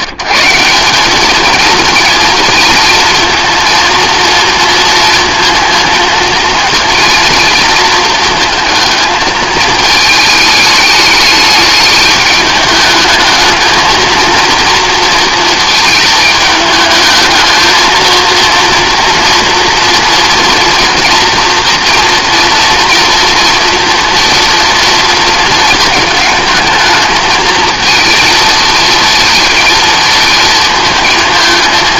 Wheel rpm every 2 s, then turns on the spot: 170, 230, 230, 230, 230, 210, 210, 230, 220, 230, 230, 230, 230, 220, 230, 220.
none